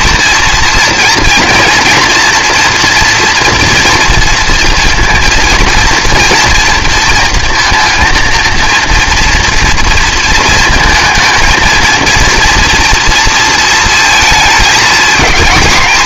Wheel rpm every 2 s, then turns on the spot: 230, 240, 230, 230, 230, 230, 230, 220.
none